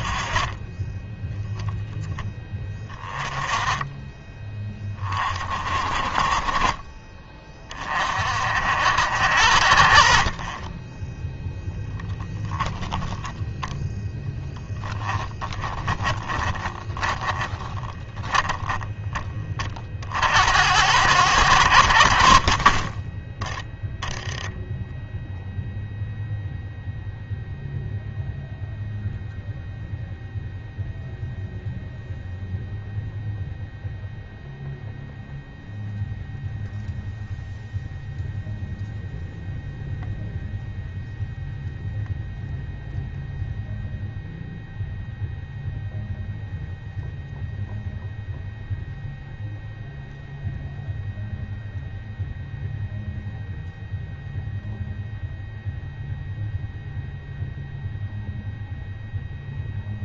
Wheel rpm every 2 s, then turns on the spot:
20, 20, 20, 30, 70, 20, 10, 10, 20, 10, 80, 30, 10, 0, 0, 0, 0, 0, 0, 0, 0, 0, 0, 0, 0, 0, 0, 0, 0, 0.
12-18